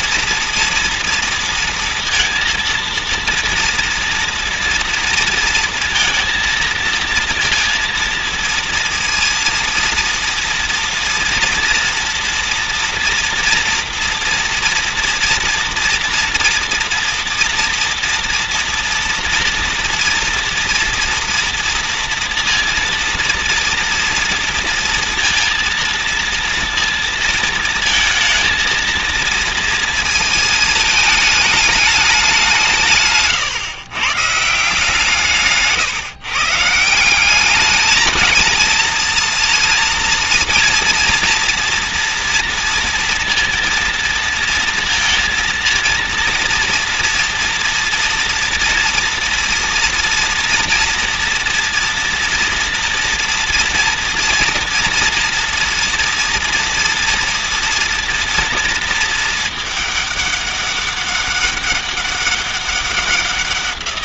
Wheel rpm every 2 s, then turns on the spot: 230, 230, 230, 230, 230, 230, 230, 230, 230, 230, 230, 230, 230, 230, 230, 230, 180, 150, 150, 220, 240, 240, 230, 230, 230, 240, 240, 230, 230, 230, 200, 190.
none